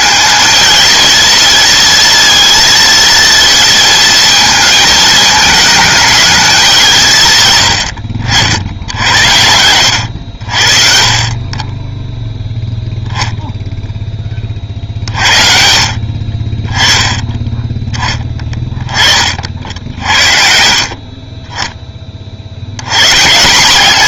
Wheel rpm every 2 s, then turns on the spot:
230, 230, 210, 190, 80, 50, 0, 40, 20, 20, 50, 90.
none